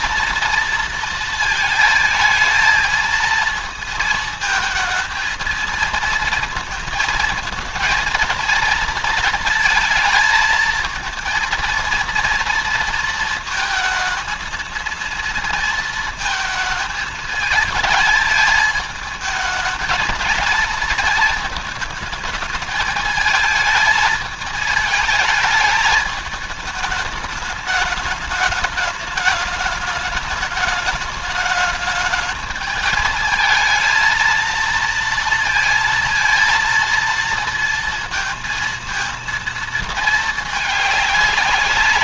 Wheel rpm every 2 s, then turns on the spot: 230, 220, 220, 220, 230, 220, 230, 230, 220, 220, 220, 220, 220, 210, 210, 210, 220, 230, 230, 230, 210.
none